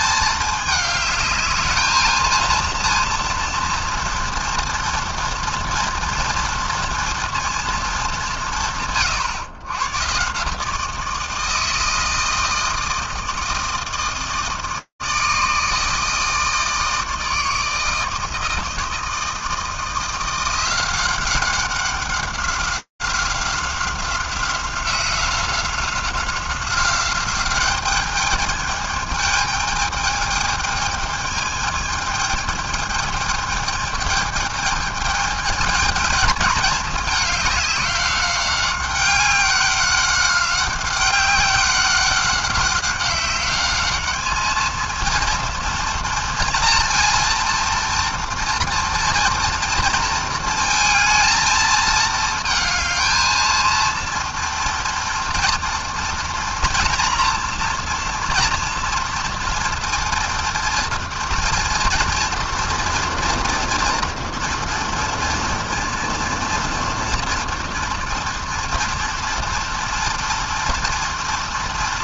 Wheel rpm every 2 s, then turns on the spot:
220, 230, 230, 230, 180, 150, 160, 160, 160, 160, 180, 190, 180, 190, 210, 220, 210, 220, 210, 190, 190, 190, 220, 230, 230, 220, 220, 230, 240, 230, 230, 230, 230, 230, 230, 230.
none